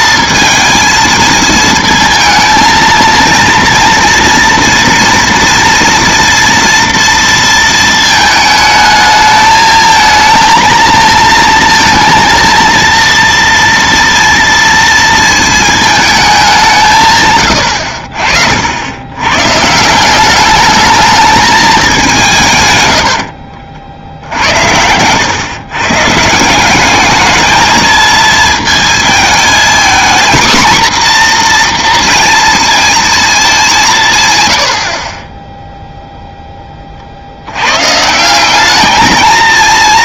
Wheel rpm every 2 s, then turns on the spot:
230, 230, 230, 230, 220, 220, 230, 230, 180, 70, 210, 120, 90, 180, 220, 240, 230, 100, 20, 190.
none